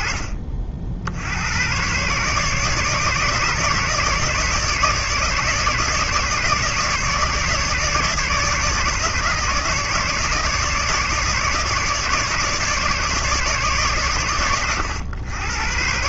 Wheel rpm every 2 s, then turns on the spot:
60, 150, 150, 150, 150, 150, 140, 110.
none